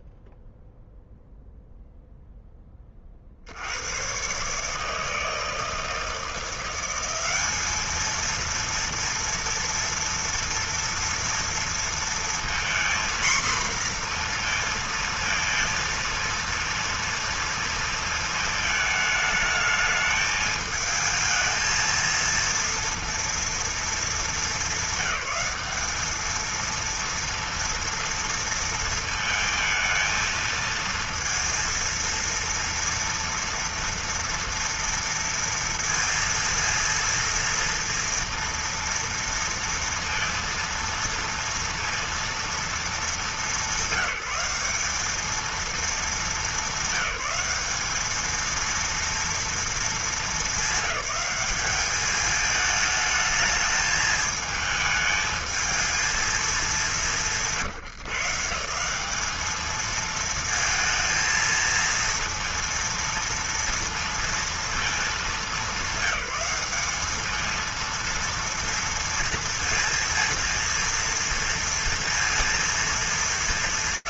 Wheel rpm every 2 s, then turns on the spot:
0, 0, 120, 170, 220, 230, 230, 240, 230, 220, 220, 230, 220, 210, 230, 220, 230, 230, 230, 230, 230, 230, 200, 210, 220, 210, 210, 220, 220, 150, 220, 230, 230, 210, 230, 230, 230.
none